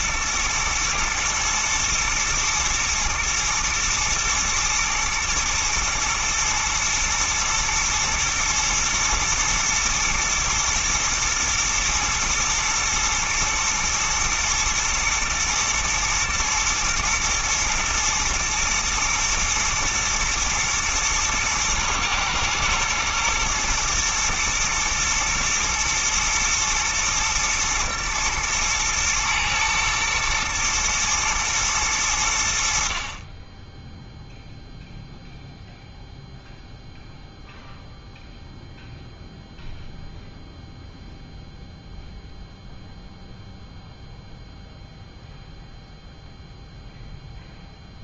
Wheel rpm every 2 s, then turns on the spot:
120, 110, 110, 110, 110, 110, 110, 120, 110, 110, 110, 120, 120, 120, 110, 110, 60, 0, 0, 0, 0, 0, 0, 0.
none